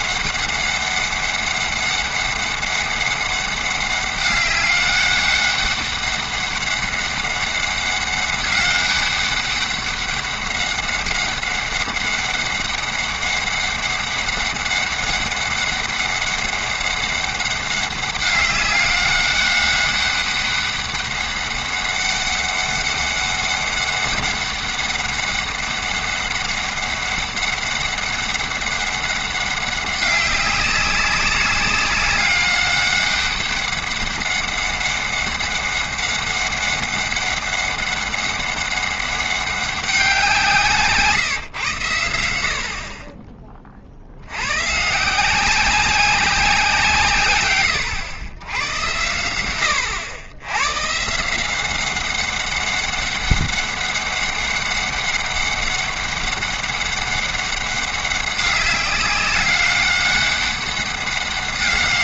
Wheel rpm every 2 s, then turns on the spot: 200, 200, 200, 200, 200, 200, 200, 200, 200, 200, 200, 200, 200, 200, 200, 200, 200, 200, 200, 200, 170, 70, 120, 170, 100, 110, 200, 200, 200, 200, 200.
none